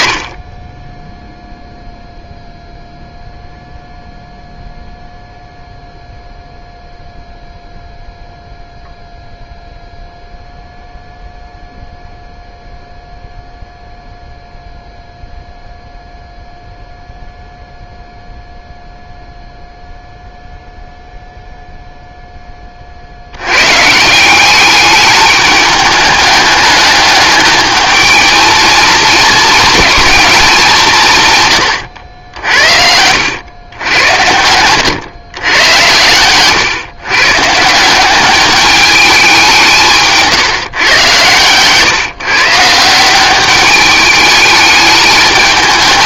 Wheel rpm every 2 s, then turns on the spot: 20, 0, 0, 0, 0, 0, 0, 0, 0, 0, 0, 20, 200, 210, 220, 190, 70, 100, 130, 210, 140, 160, 210.
32-34